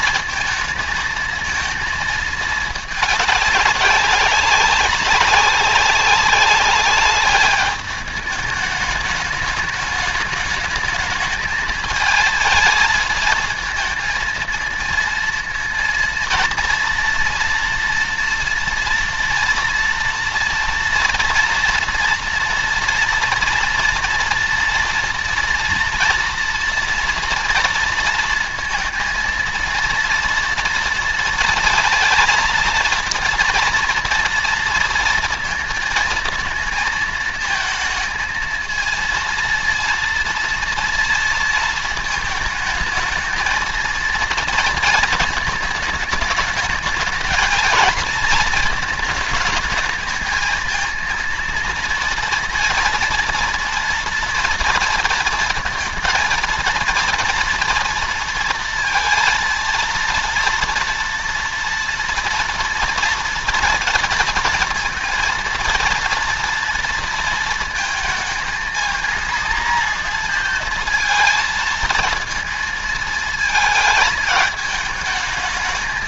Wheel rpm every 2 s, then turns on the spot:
220, 220, 200, 200, 210, 210, 220, 230, 230, 230, 230, 230, 230, 230, 230, 230, 230, 230, 230, 220, 230, 220, 230, 220, 220, 220, 230, 230, 230, 230, 230, 230, 230, 230, 220, 230, 230, 220.
none